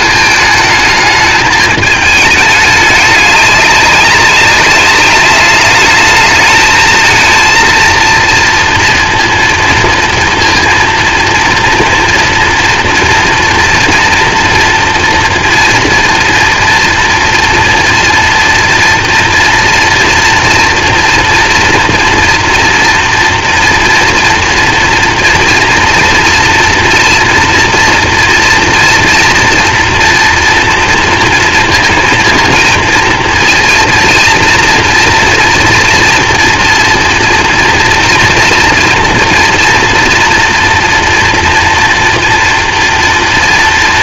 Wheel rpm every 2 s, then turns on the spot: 220, 210, 200, 220, 230, 230, 240, 240, 230, 240, 230, 230, 230, 230, 230, 230, 230, 230, 230, 230, 230, 230.
none